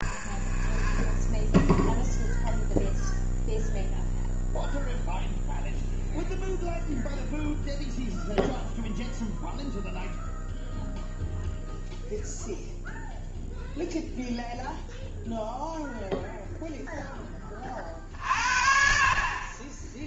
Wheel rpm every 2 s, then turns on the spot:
0, 0, 0, 0, 0, 0, 0, 0, 0, 60.
none